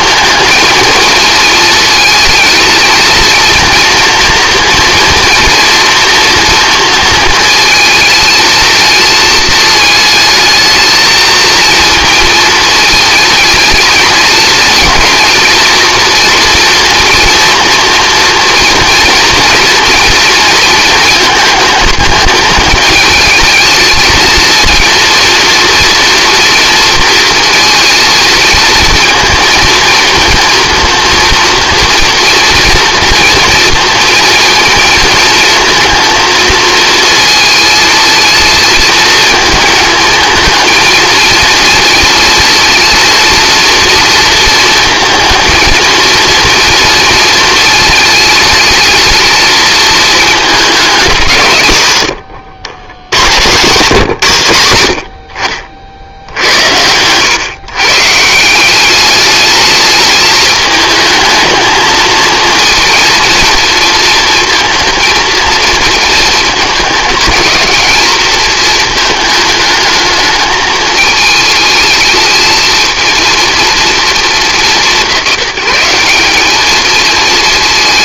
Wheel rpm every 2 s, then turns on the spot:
230, 230, 230, 230, 220, 220, 220, 230, 230, 230, 230, 210, 230, 230, 230, 230, 240, 230, 230, 220, 230, 230, 230, 230, 220, 210, 100, 80, 90, 180, 220, 230, 230, 220, 220, 220, 220, 190, 220.
none